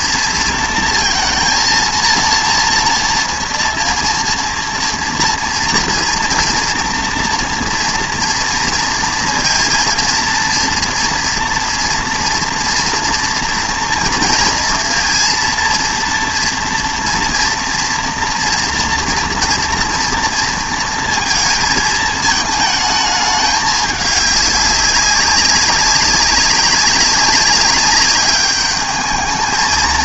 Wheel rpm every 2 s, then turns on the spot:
230, 230, 230, 230, 230, 230, 240, 230, 230, 230, 230, 220, 200, 190, 210.
none